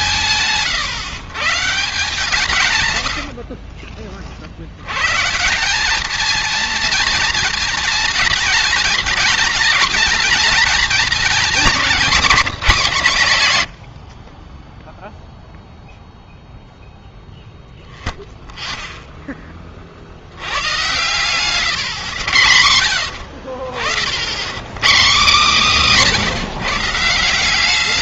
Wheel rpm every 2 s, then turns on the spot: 140, 140, 60, 220, 220, 220, 220, 30, 0, 0, 90, 100, 100, 140.
none